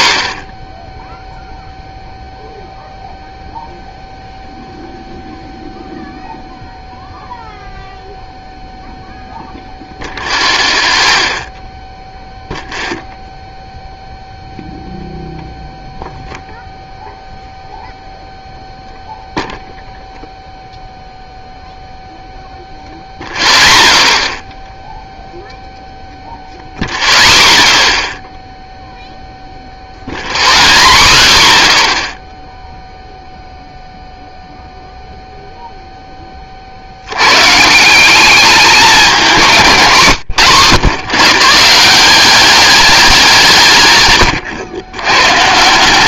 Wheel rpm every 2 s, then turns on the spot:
10, 0, 0, 0, 0, 0, 0, 0, 0, 0, 0, 0, 0, 0, 0, 0, 0, 0, 40, 200, 110, 200, 70.
none